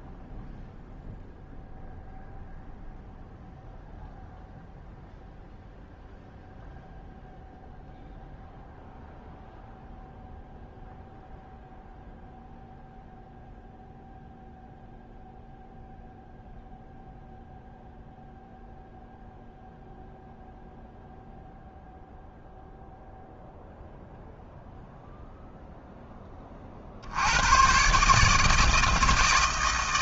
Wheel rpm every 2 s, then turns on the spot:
0, 0, 0, 0, 0, 0, 0, 0, 0, 0, 0, 0, 0, 60, 160.
none